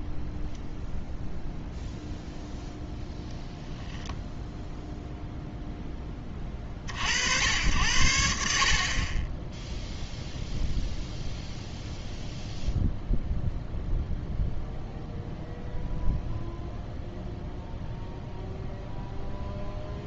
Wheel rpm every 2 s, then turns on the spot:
0, 0, 0, 50, 40, 0, 0, 0, 0, 0.
none